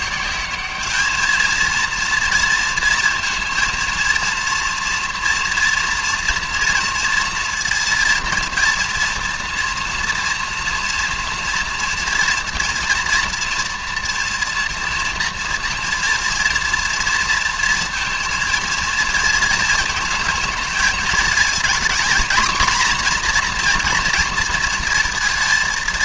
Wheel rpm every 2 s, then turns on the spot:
200, 230, 230, 230, 230, 240, 240, 230, 230, 220, 220, 240, 230.
none